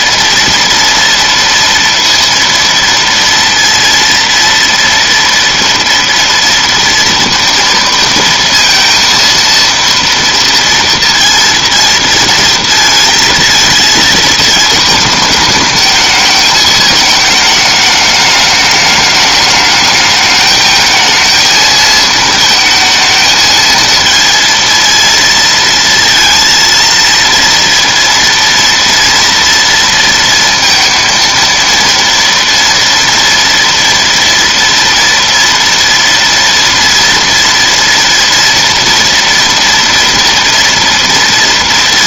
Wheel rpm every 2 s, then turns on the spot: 230, 230, 230, 230, 230, 230, 230, 220, 220, 210, 220, 220, 230, 230, 230, 230, 230, 230, 230, 230, 230.
none